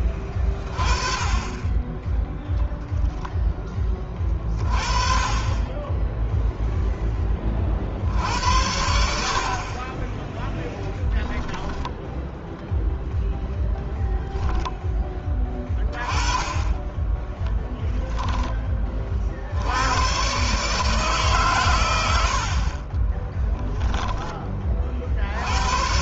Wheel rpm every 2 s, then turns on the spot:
20, 0, 30, 0, 90, 10, 0, 10, 10, 20, 140, 40, 40.
10-12